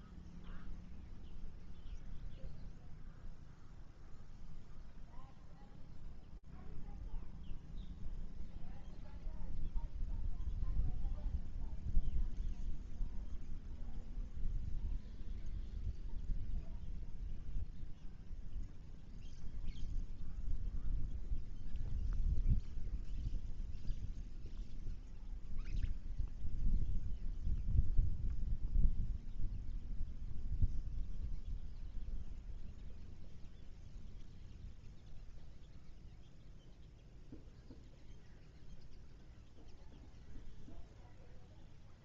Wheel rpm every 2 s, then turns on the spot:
0, 0, 0, 0, 0, 0, 0, 0, 0, 0, 0, 0, 0, 0, 0, 0, 0, 0, 0, 0, 0.
none